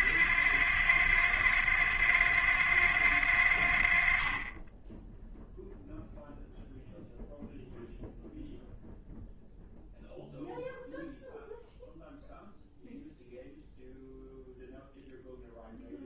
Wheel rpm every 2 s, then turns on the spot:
90, 90, 10, 0, 0, 0, 0, 0.
none